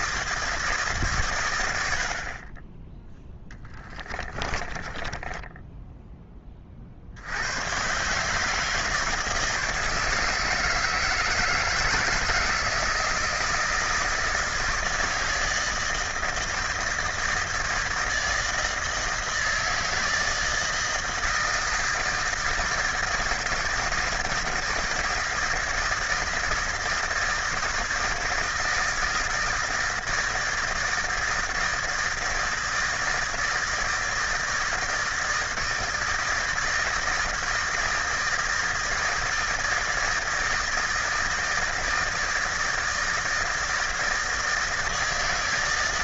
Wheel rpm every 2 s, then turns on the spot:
160, 30, 20, 20, 150, 150, 160, 160, 160, 160, 160, 160, 160, 160, 160, 160, 160, 160, 160, 160, 160, 160, 160.
4-6